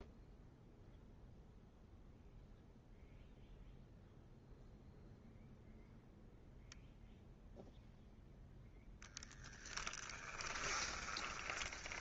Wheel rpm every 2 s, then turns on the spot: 0, 0, 0, 0, 0, 20.
10-12